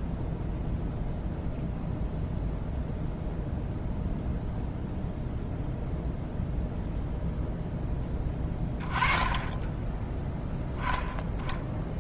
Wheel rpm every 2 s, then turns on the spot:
0, 0, 0, 0, 20, 10.
none